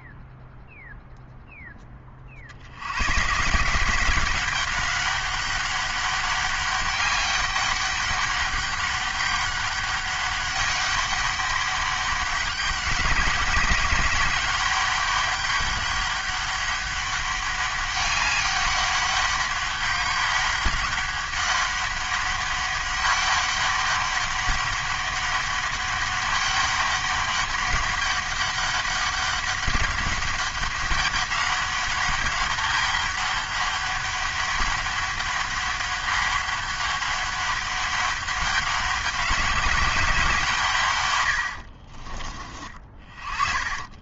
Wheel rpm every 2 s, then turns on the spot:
0, 70, 190, 200, 200, 200, 200, 200, 200, 200, 200, 200, 200, 200, 200, 200, 200, 200, 200, 200, 150, 30.
none